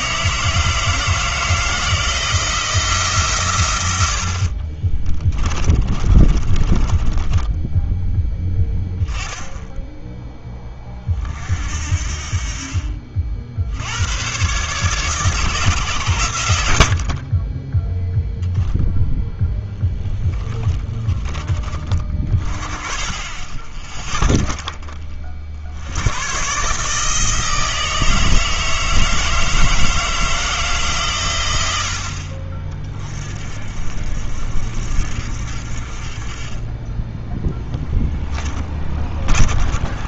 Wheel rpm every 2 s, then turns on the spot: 160, 170, 50, 30, 10, 20, 40, 140, 80, 0, 20, 20, 20, 150, 160, 160, 50, 50, 10, 20.
4-8 20-22 38-40